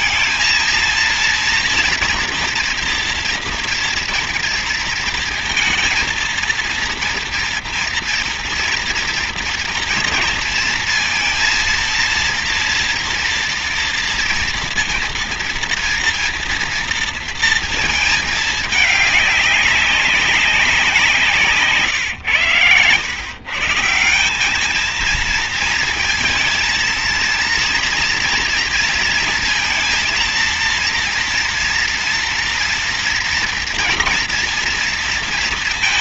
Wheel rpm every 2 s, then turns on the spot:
230, 230, 230, 230, 230, 230, 230, 230, 230, 200, 170, 120, 220, 230, 230, 230, 230, 230.
none